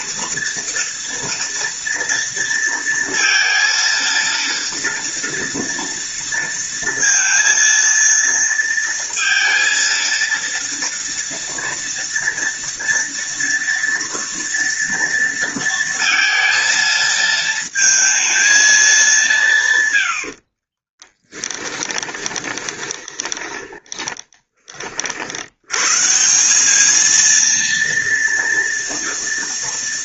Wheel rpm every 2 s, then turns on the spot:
230, 230, 230, 230, 230, 230, 230, 230, 220, 220, 40, 20, 30, 190, 230.
20-24